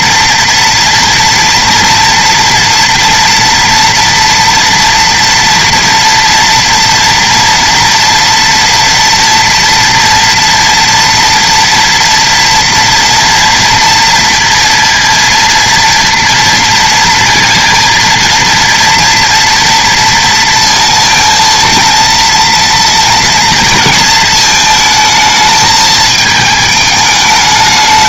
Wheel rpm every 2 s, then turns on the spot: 240, 240, 230, 230, 230, 230, 230, 230, 230, 230, 230, 230, 220, 220.
none